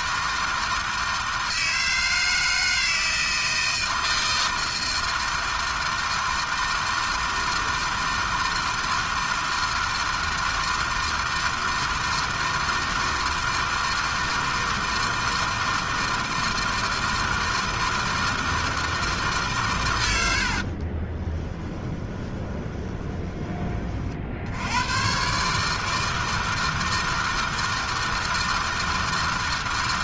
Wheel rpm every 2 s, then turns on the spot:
160, 160, 160, 160, 160, 160, 160, 160, 160, 160, 60, 20, 80, 160, 160.
20-24